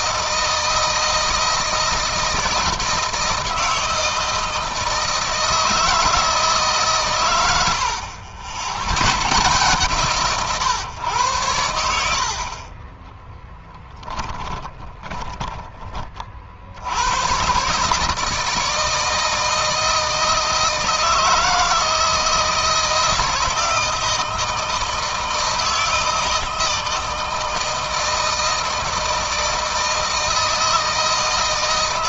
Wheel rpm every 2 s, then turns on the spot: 160, 160, 160, 140, 110, 120, 30, 10, 80, 160, 160, 160, 160, 160, 160, 160.
12-16